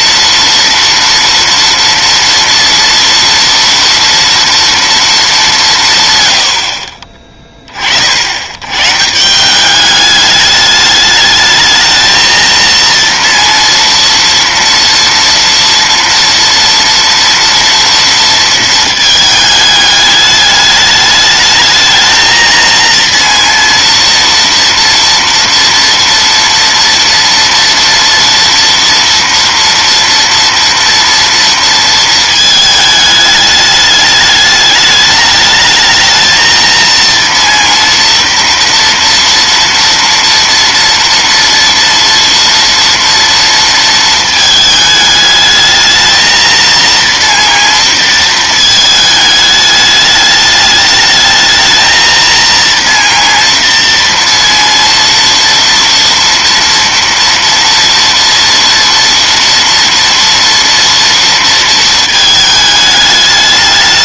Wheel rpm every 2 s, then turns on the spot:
230, 230, 220, 30, 130, 210, 230, 230, 230, 220, 210, 230, 230, 230, 240, 230, 220, 210, 230, 230, 240, 230, 210, 230, 220, 210, 230, 230, 230, 230, 230, 210.
none